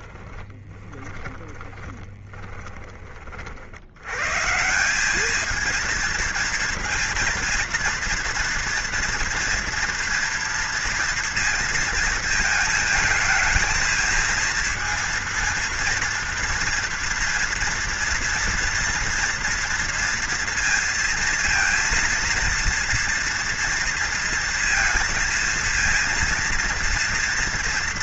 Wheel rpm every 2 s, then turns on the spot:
20, 30, 190, 230, 230, 230, 220, 230, 230, 230, 230, 230, 230, 230.
0-4